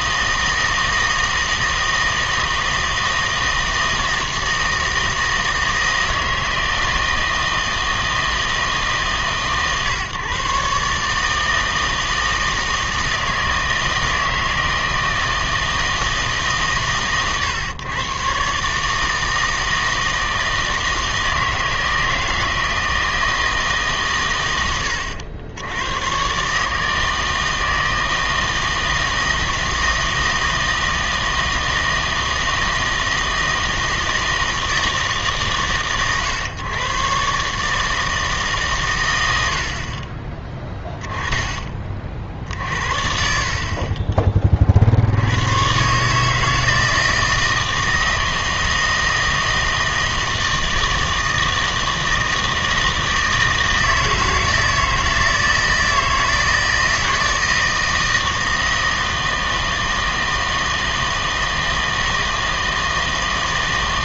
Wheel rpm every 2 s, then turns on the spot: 160, 160, 160, 160, 160, 140, 160, 160, 140, 140, 160, 160, 100, 150, 160, 160, 160, 160, 130, 140, 10, 60, 30, 160, 160, 160, 160, 160, 160, 160, 160, 160.
none